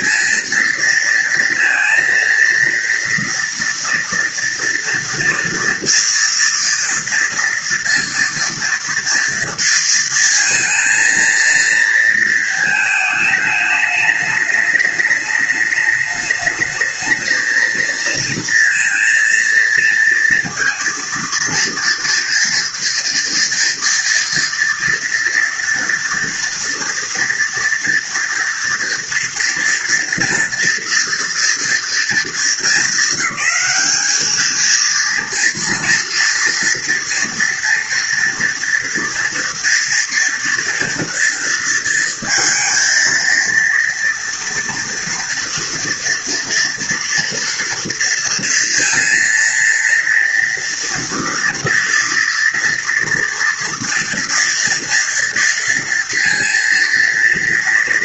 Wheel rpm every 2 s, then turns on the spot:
230, 230, 230, 230, 230, 230, 220, 210, 220, 230, 230, 230, 230, 230, 230, 230, 210, 230, 230, 240, 230, 230, 230, 230, 230, 230, 230, 230, 230.
none